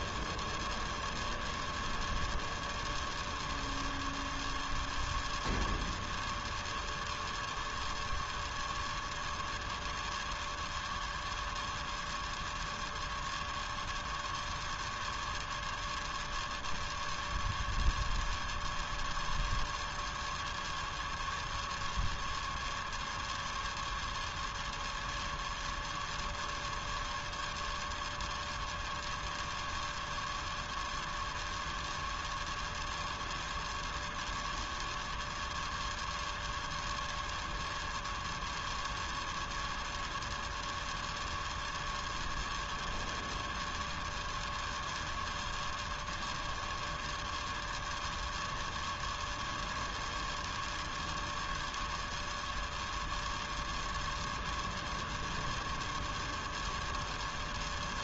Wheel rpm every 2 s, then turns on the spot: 0, 0, 0, 0, 0, 0, 0, 0, 0, 0, 0, 0, 0, 0, 0, 0, 0, 0, 0, 0, 0, 0, 0, 0, 0, 0, 0, 0, 0.
none